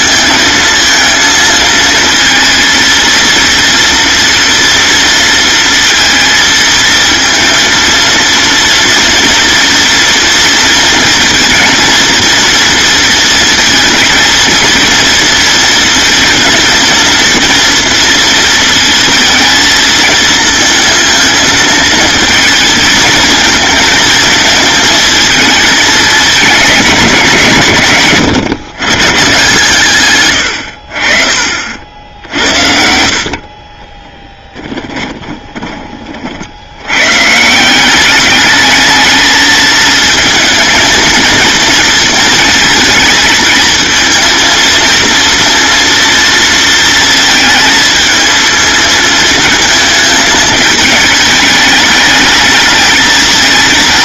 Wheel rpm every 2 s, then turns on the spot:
230, 230, 230, 230, 230, 230, 230, 230, 230, 230, 230, 220, 220, 210, 130, 60, 60, 20, 110, 220, 230, 230, 230, 220, 220, 210, 220.
34-36